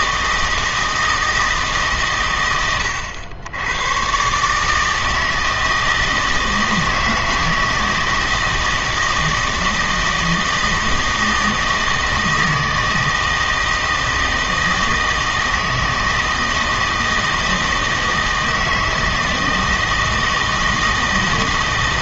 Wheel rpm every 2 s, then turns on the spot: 160, 110, 150, 160, 160, 160, 160, 160, 160, 160, 160.
none